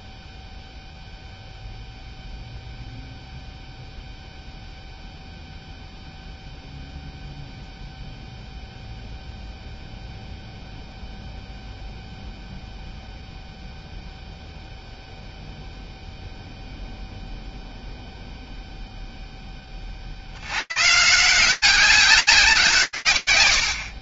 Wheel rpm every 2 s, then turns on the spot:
0, 0, 0, 0, 0, 0, 0, 0, 0, 0, 160, 150.
none